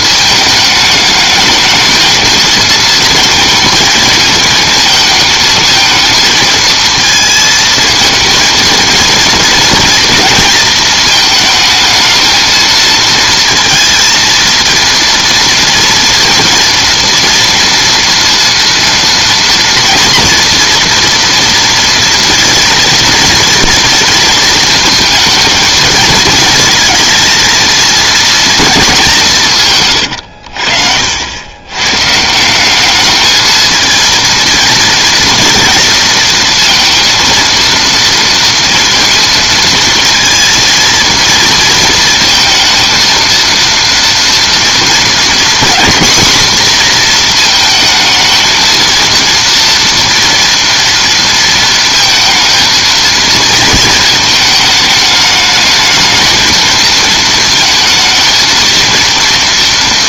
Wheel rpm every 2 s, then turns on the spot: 220, 230, 220, 230, 220, 230, 220, 230, 230, 230, 230, 230, 230, 230, 220, 80, 170, 230, 230, 230, 230, 230, 240, 240, 230, 240, 220, 220, 220, 230.
none